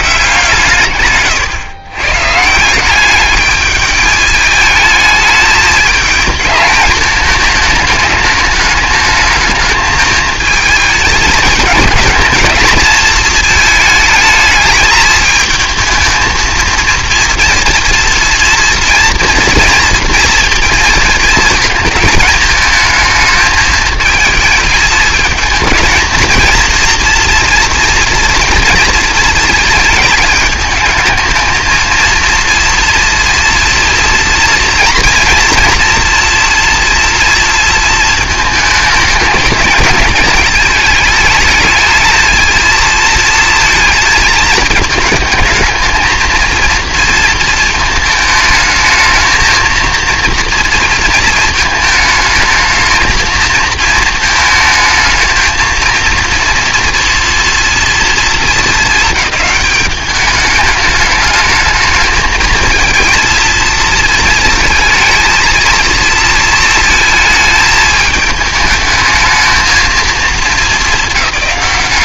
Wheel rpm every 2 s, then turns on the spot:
150, 150, 210, 220, 210, 220, 220, 220, 230, 230, 230, 220, 220, 230, 230, 220, 230, 230, 230, 220, 220, 220, 220, 230, 220, 230, 220, 220, 230, 220, 210, 220, 220, 230, 210, 220.
none